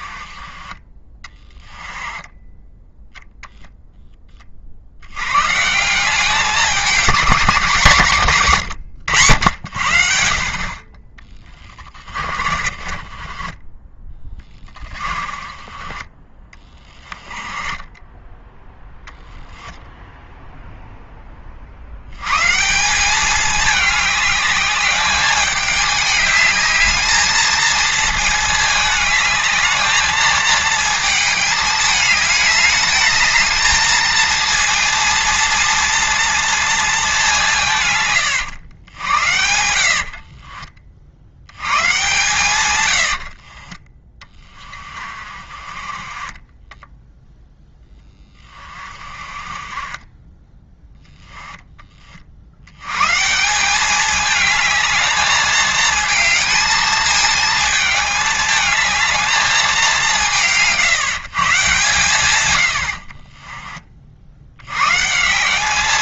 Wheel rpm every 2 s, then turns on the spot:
20, 0, 100, 200, 100, 30, 30, 20, 20, 0, 10, 190, 210, 220, 210, 220, 220, 230, 210, 90, 60, 80, 40, 0, 30, 10, 140, 210, 220, 220, 150, 50, 130.
0-2 10-18 38-40 42-46 50-52 62-64